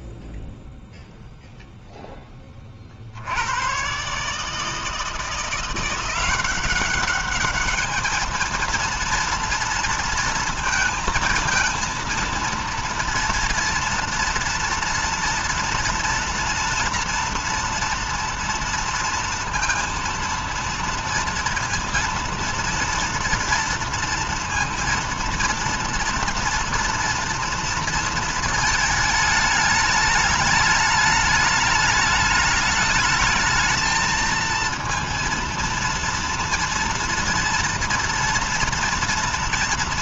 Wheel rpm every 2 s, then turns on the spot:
0, 10, 130, 180, 220, 230, 230, 230, 230, 230, 230, 230, 230, 230, 230, 210, 210, 230, 230, 230.
none